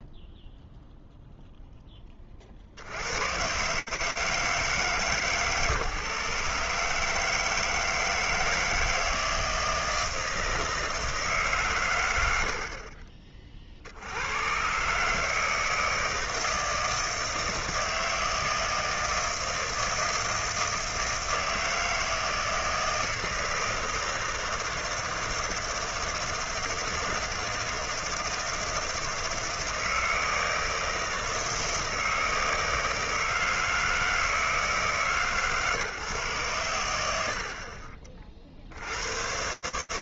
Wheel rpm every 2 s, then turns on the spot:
0, 40, 150, 150, 160, 160, 60, 110, 160, 160, 160, 160, 160, 160, 160, 160, 160, 160, 120, 60.
12-14